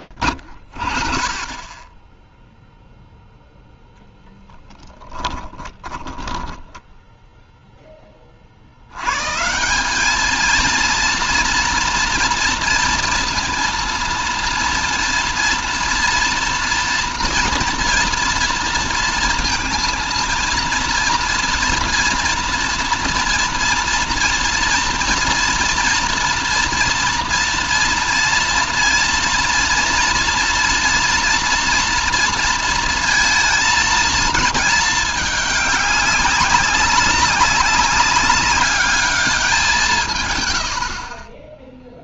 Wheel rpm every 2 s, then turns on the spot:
50, 0, 10, 10, 80, 230, 230, 230, 230, 230, 230, 240, 230, 240, 230, 240, 230, 210, 200, 200, 70.
4-8